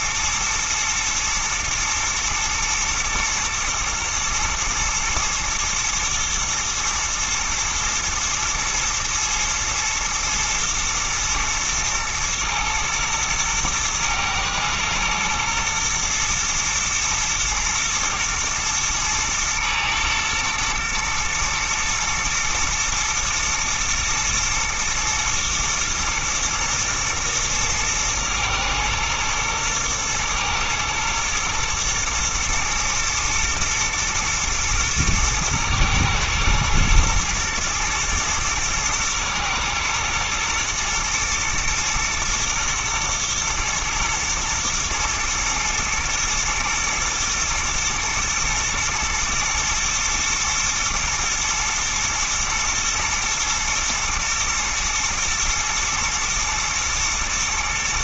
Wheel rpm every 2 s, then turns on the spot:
110, 110, 120, 110, 120, 110, 110, 110, 120, 110, 110, 110, 110, 110, 110, 110, 120, 110, 120, 110, 110, 120, 110, 110, 110, 120, 110, 120, 120.
none